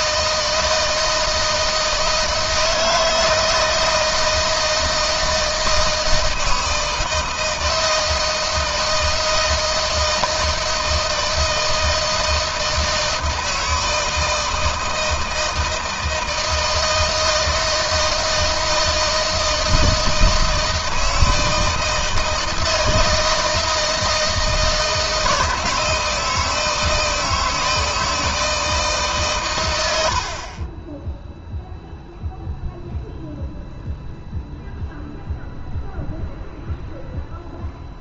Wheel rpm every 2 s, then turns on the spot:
160, 160, 160, 160, 160, 160, 160, 160, 160, 160, 160, 160, 160, 160, 150, 20, 0, 0, 0.
none